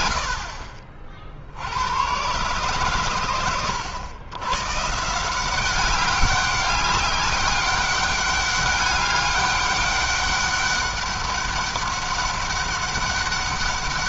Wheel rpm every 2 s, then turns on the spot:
50, 120, 140, 200, 200, 200, 200.
none